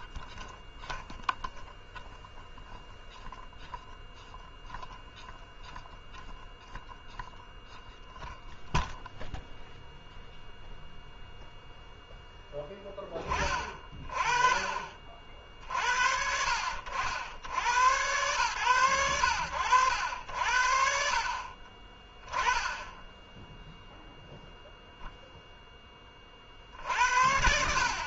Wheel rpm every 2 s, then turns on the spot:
0, 0, 0, 0, 0, 0, 10, 30, 70, 80, 50, 10, 0, 50.
none